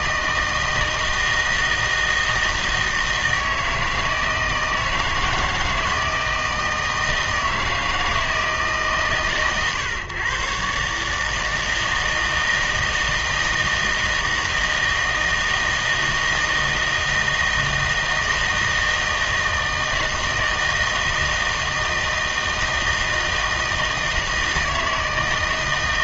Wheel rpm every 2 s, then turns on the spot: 160, 160, 160, 160, 150, 130, 160, 160, 160, 160, 160, 160, 160.
none